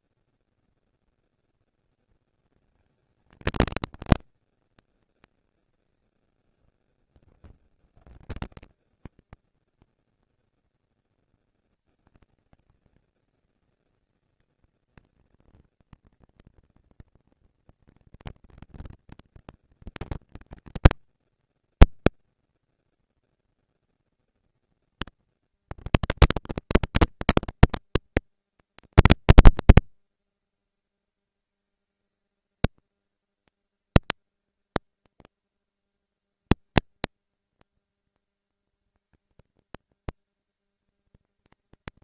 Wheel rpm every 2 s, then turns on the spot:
230, 220, 200, 130, 160, 210, 210, 220, 230, 230, 230, 230, 240, 230, 230, 230, 230, 230, 230, 230, 200.
none